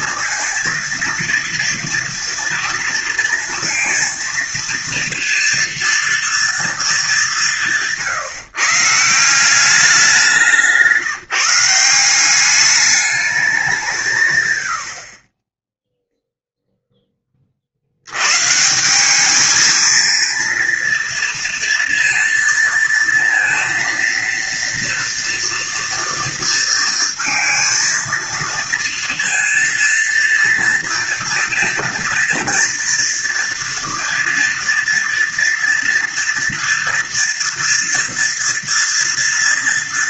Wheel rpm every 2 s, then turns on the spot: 230, 230, 230, 210, 160, 170, 210, 130, 10, 170, 230, 230, 230, 230, 230, 230, 230, 230, 230, 230.
none